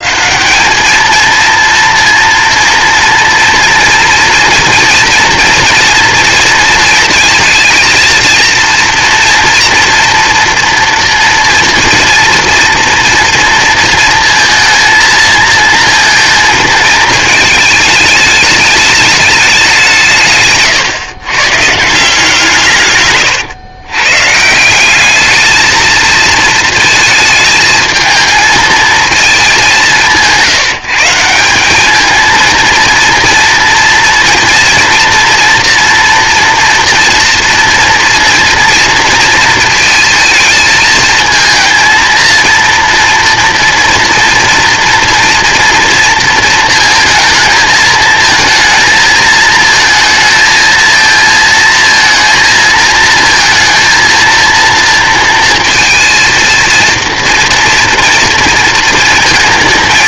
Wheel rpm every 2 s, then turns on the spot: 190, 230, 230, 230, 230, 230, 230, 230, 220, 210, 130, 140, 170, 230, 220, 170, 220, 230, 240, 230, 230, 230, 230, 230, 220, 220, 230, 230, 230, 230.
none